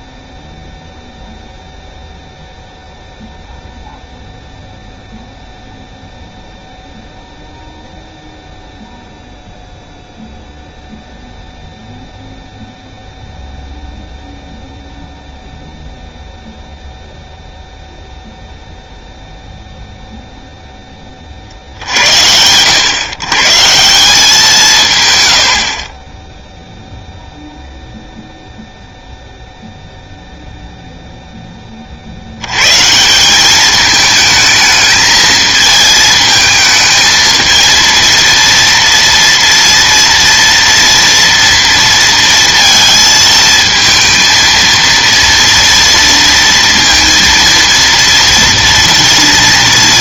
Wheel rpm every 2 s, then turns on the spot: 0, 0, 0, 0, 0, 0, 0, 0, 0, 0, 40, 140, 110, 0, 0, 0, 150, 220, 220, 230, 230, 230, 230, 230, 230.
none